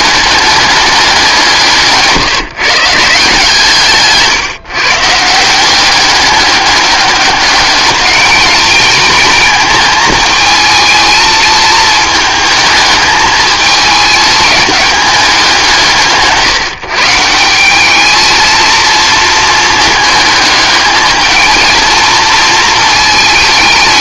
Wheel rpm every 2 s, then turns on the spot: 200, 160, 150, 200, 220, 220, 220, 210, 150, 220, 210, 220.
none